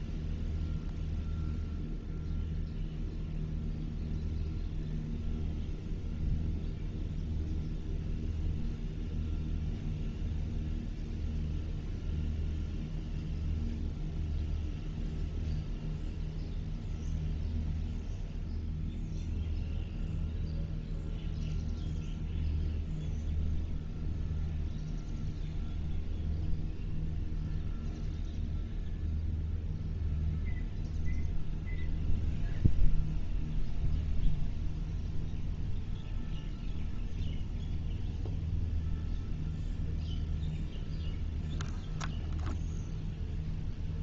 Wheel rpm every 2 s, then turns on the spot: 0, 0, 0, 0, 0, 0, 0, 0, 0, 0, 0, 0, 0, 0, 0, 0, 0, 0, 0, 0, 0, 0.
none